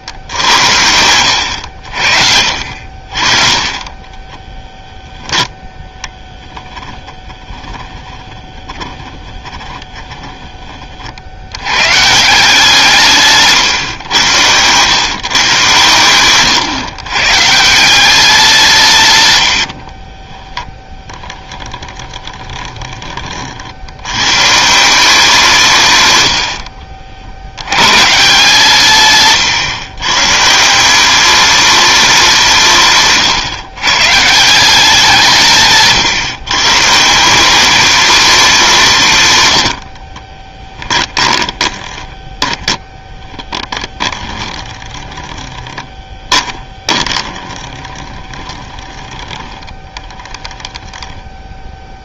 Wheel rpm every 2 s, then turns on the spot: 80, 60, 10, 20, 20, 30, 160, 120, 130, 160, 10, 20, 170, 50, 140, 170, 150, 180, 140, 180, 10, 10, 20, 20, 20, 10.
6-10 20-24 40-50